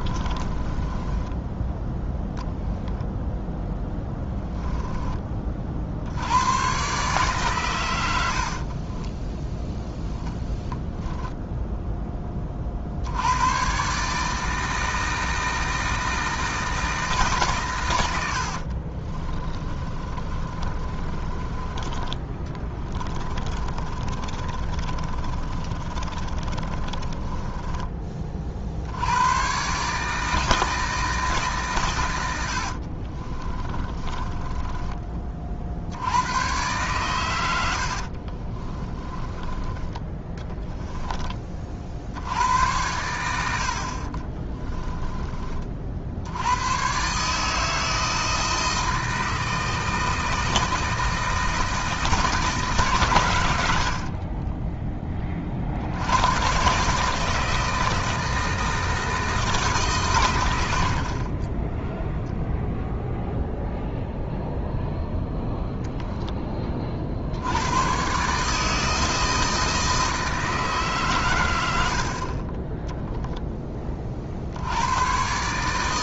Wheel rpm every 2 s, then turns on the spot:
20, 0, 10, 130, 30, 0, 50, 160, 160, 40, 30, 20, 30, 30, 80, 160, 60, 20, 130, 20, 10, 110, 20, 130, 160, 160, 130, 10, 140, 160, 80, 0, 0, 40, 160, 150, 0, 100.
0-2 8-10 18-28 32-36 38-40 44-46